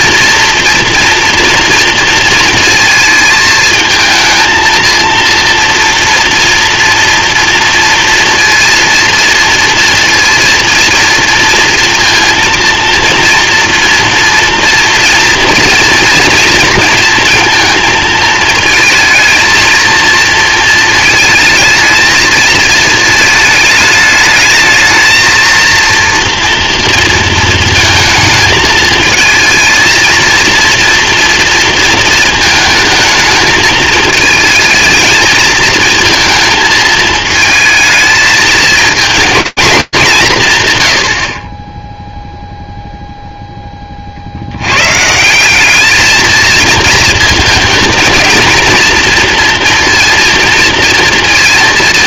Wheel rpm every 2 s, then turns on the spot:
230, 220, 230, 230, 230, 240, 230, 230, 220, 220, 220, 220, 220, 230, 220, 230, 220, 220, 220, 220, 140, 0, 100, 220, 230, 230.
none